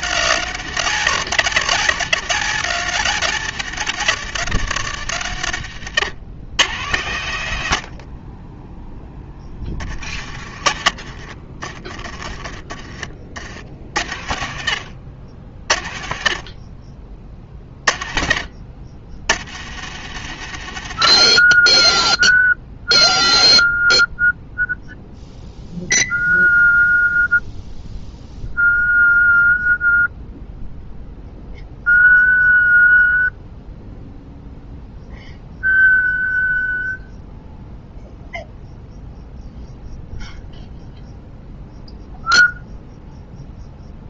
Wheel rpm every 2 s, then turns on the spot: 130, 120, 80, 100, 10, 30, 40, 80, 30, 70, 40, 0, 0, 0, 0, 0, 0, 0, 0, 0, 0, 0.
10-12